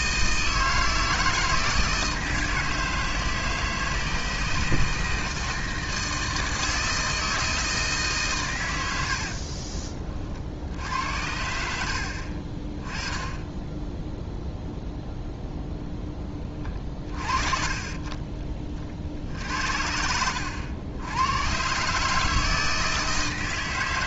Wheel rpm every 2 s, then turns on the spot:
160, 160, 160, 160, 100, 80, 30, 0, 40, 40, 90, 160.
none